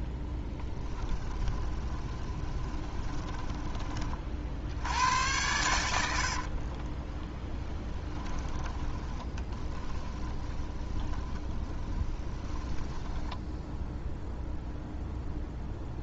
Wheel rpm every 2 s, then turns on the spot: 10, 20, 80, 30, 20, 30, 10, 0.
0-4 6-14